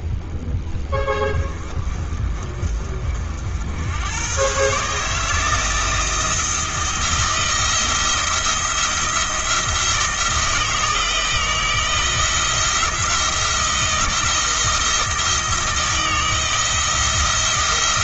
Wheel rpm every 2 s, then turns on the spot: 20, 40, 130, 170, 170, 160, 170, 160, 170.
none